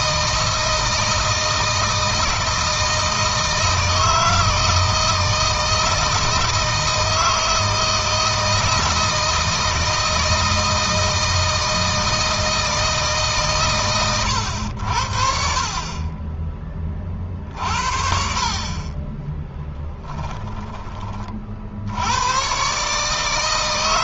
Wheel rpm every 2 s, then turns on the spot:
160, 160, 160, 160, 160, 160, 160, 70, 20, 30, 20, 130.
none